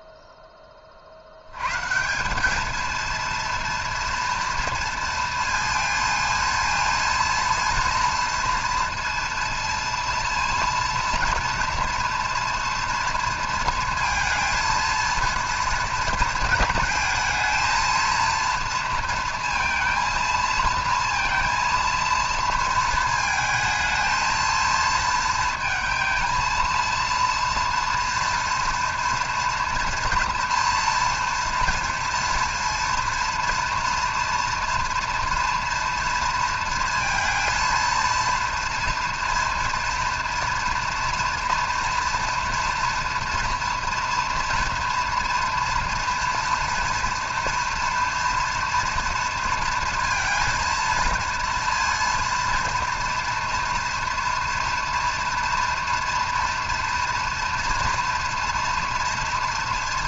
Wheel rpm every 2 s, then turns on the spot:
10, 210, 230, 230, 230, 230, 240, 220, 230, 230, 230, 230, 220, 230, 240, 230, 230, 230, 230, 240, 230, 230, 230, 230, 230, 230, 230, 230, 230, 230.
none